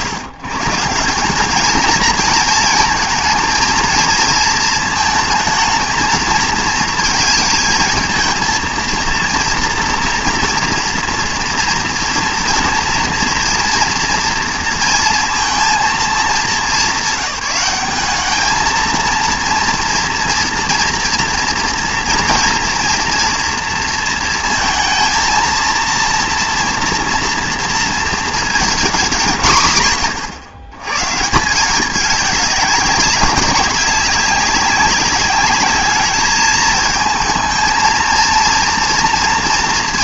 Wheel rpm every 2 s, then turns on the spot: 150, 230, 220, 220, 230, 230, 230, 230, 200, 220, 230, 230, 220, 230, 230, 120, 200, 190, 220, 230.
none